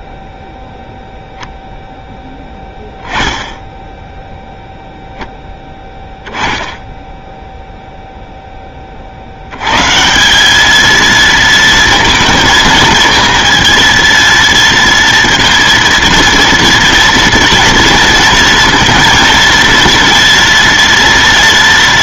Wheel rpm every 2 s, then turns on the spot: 0, 10, 0, 10, 20, 210, 220, 230, 230, 230, 240.
none